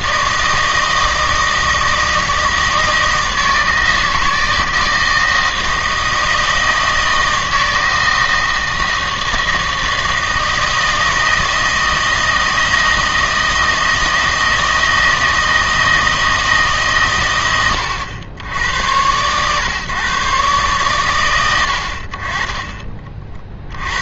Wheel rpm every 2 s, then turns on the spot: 160, 160, 160, 160, 160, 160, 160, 160, 150, 90, 130, 30.
none